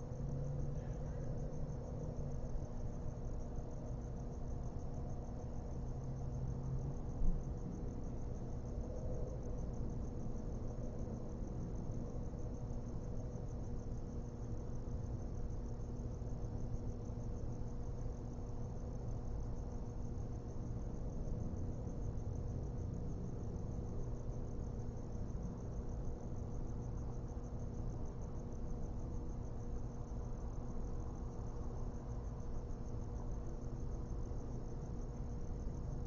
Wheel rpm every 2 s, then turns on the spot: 0, 0, 0, 0, 0, 0, 0, 0, 0, 0, 0, 0, 0, 0, 0, 0, 0, 0.
none